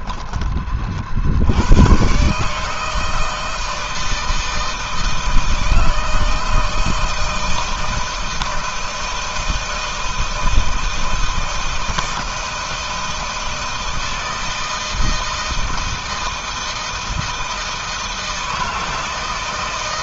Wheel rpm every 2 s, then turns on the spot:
30, 150, 160, 160, 160, 160, 160, 160, 160, 160.
none